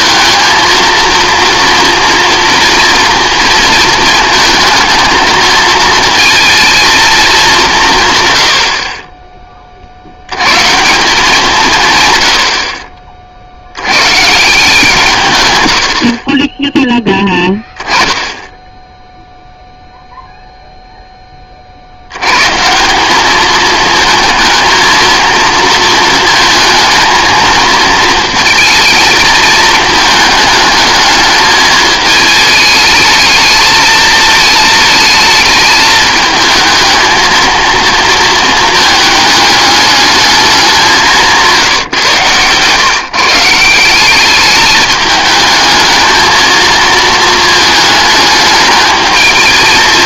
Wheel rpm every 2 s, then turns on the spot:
230, 230, 220, 230, 60, 160, 60, 160, 10, 0, 0, 170, 230, 230, 220, 210, 220, 220, 220, 220, 190, 130, 210, 230, 220.
none